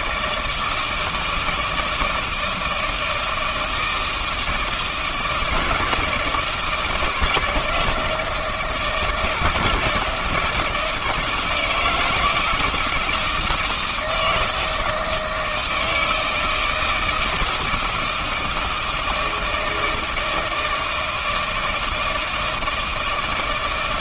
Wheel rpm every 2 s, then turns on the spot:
160, 160, 160, 160, 160, 160, 170, 160, 160, 160, 160, 160.
none